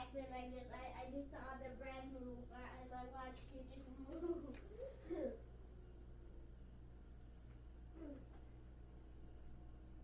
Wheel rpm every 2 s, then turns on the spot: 0, 0, 0, 0, 0.
none